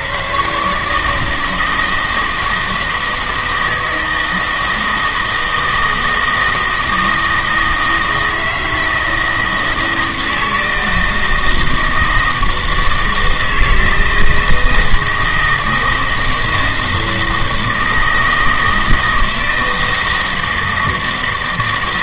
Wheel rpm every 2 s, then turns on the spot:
140, 160, 160, 160, 160, 160, 160, 160, 160, 160, 160.
none